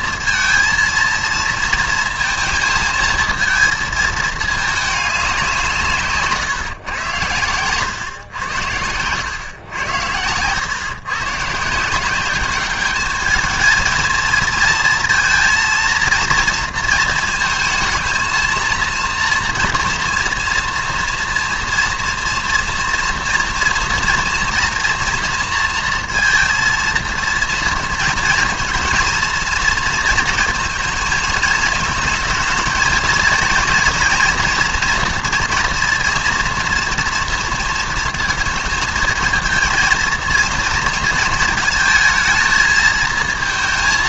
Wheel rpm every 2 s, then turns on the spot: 230, 230, 220, 140, 100, 110, 200, 230, 230, 230, 230, 230, 240, 230, 230, 230, 220, 230, 230, 230, 230, 220.
none